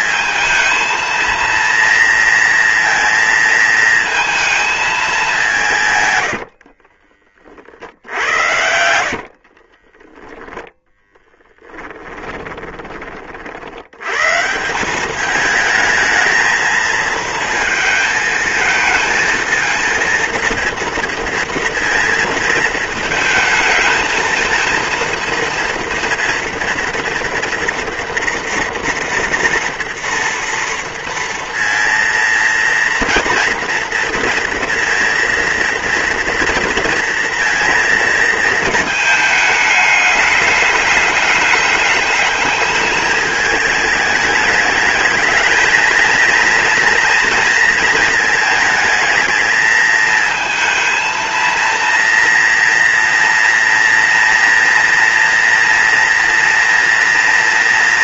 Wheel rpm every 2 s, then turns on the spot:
230, 230, 210, 50, 70, 10, 30, 190, 220, 230, 230, 220, 230, 230, 230, 230, 230, 230, 230, 220, 210, 210, 210, 230, 220, 230, 230, 230, 240.
6-12